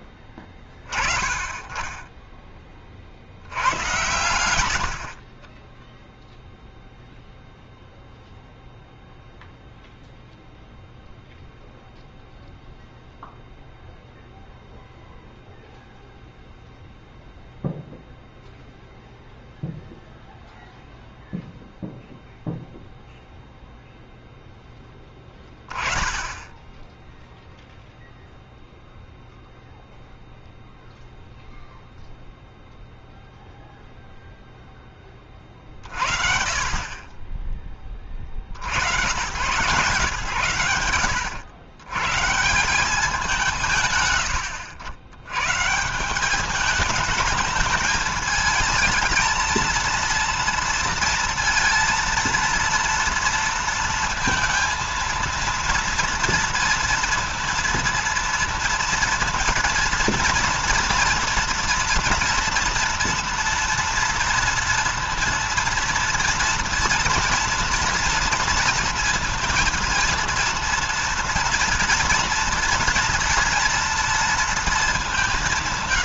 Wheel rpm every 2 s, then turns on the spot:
20, 20, 90, 0, 0, 0, 0, 0, 0, 0, 0, 0, 0, 10, 0, 0, 0, 0, 50, 70, 110, 170, 80, 210, 220, 230, 230, 230, 230, 230, 230, 230, 230, 230, 230, 230, 230, 220.
none